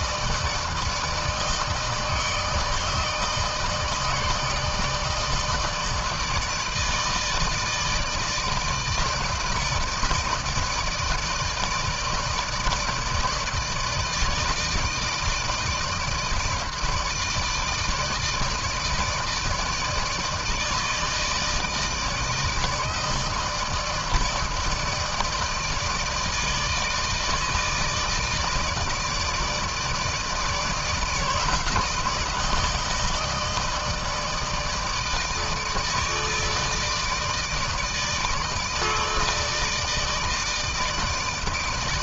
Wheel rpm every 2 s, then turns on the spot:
160, 160, 160, 160, 160, 160, 150, 160, 160, 160, 160, 160, 160, 150, 160, 160, 160, 160, 160, 150, 160.
none